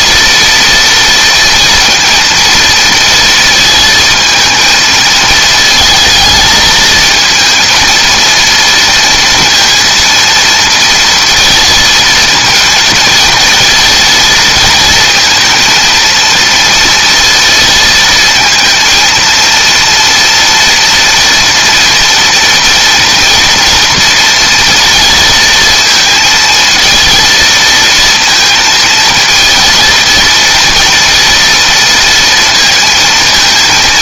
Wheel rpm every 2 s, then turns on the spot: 230, 230, 220, 220, 230, 230, 230, 230, 230, 230, 230, 240, 230, 230, 230, 230, 230.
none